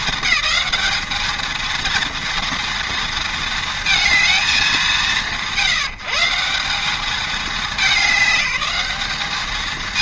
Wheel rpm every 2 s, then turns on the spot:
200, 230, 180, 180, 200.
none